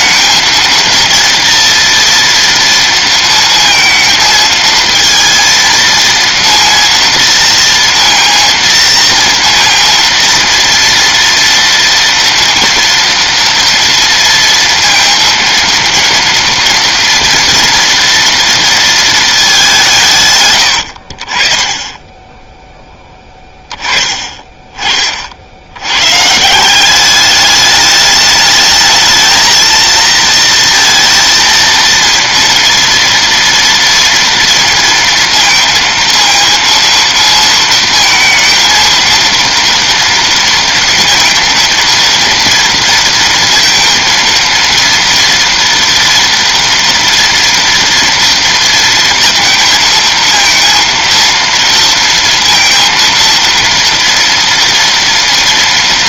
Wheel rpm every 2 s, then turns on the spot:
230, 230, 230, 230, 230, 230, 230, 230, 230, 220, 70, 10, 40, 200, 220, 230, 240, 230, 230, 230, 230, 230, 230, 230, 230, 230, 230, 240.
none